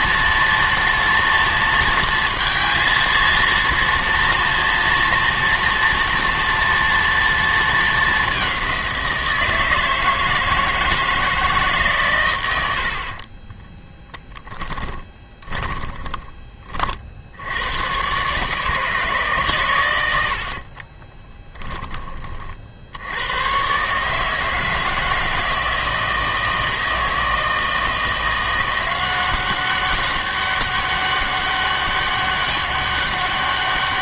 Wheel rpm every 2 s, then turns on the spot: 230, 230, 230, 230, 190, 160, 80, 10, 30, 140, 50, 60, 160, 160, 180, 200, 200.
14-16